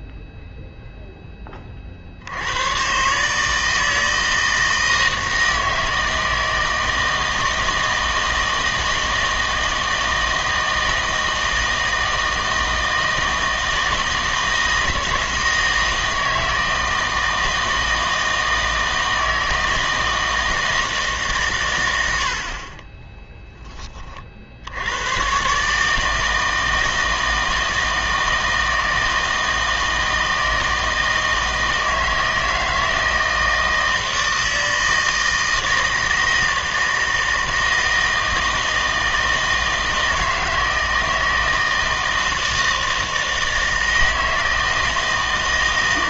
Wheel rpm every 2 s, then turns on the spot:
0, 100, 160, 160, 160, 160, 160, 160, 160, 160, 160, 50, 60, 160, 160, 160, 160, 160, 160, 160, 160, 160, 160.
none